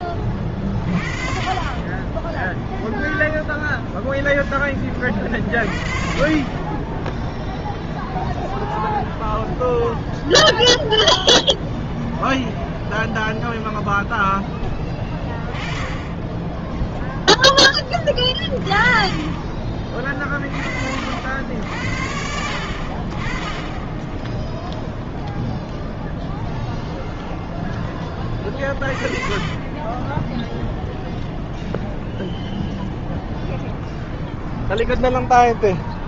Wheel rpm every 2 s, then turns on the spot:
40, 0, 30, 10, 0, 0, 0, 20, 0, 20, 80, 40, 0, 0, 30, 0, 0, 0.
6-8 28-30